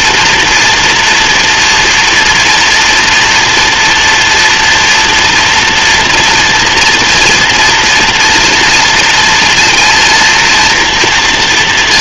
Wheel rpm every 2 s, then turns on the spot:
230, 240, 240, 230, 230, 230.
none